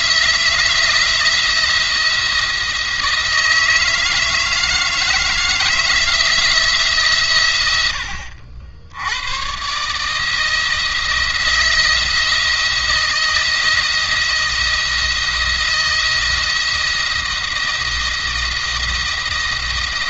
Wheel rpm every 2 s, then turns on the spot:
170, 160, 160, 150, 80, 160, 170, 170, 170, 170.
none